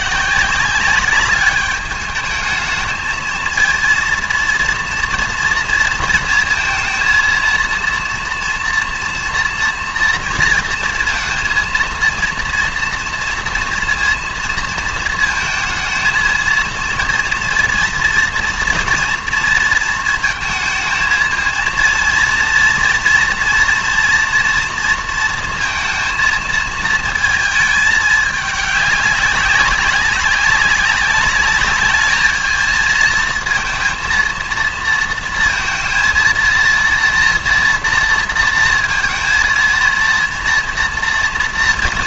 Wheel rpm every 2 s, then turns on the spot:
180, 210, 230, 230, 240, 230, 230, 230, 230, 230, 230, 230, 230, 230, 210, 190, 220, 230, 230, 230, 230.
none